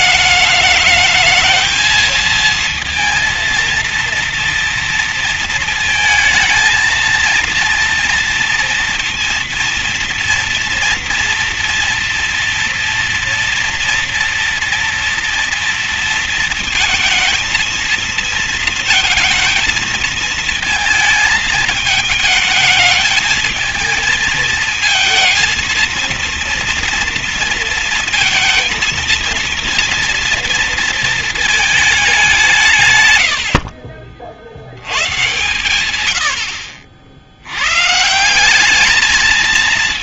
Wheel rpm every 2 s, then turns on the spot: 210, 230, 230, 230, 230, 230, 230, 230, 220, 230, 220, 220, 230, 230, 230, 230, 170, 70, 80, 190.
none